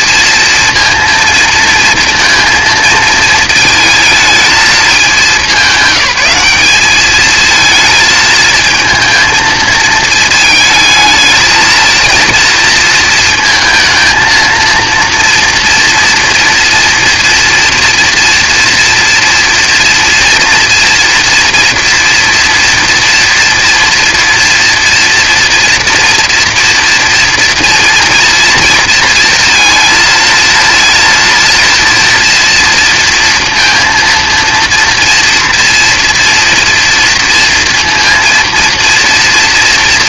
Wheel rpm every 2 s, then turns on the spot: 230, 220, 210, 210, 220, 220, 230, 230, 230, 230, 230, 230, 230, 230, 230, 230, 230, 230, 230, 230.
none